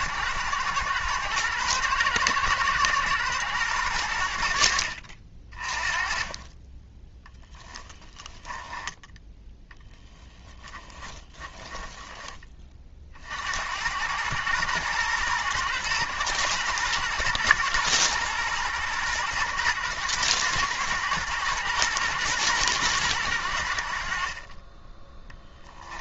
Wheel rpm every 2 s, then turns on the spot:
110, 120, 60, 20, 10, 20, 30, 110, 110, 110, 110, 110, 10.
10-12